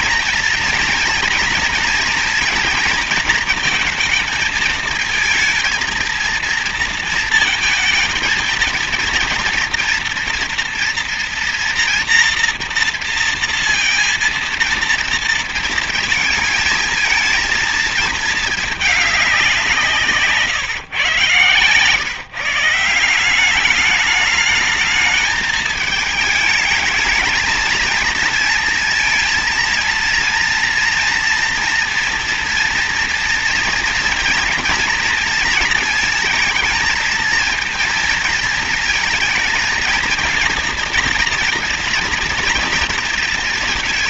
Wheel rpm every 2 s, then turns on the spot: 230, 230, 220, 230, 230, 230, 230, 230, 220, 210, 130, 170, 210, 220, 230, 230, 230, 230, 220, 230, 230, 230.
none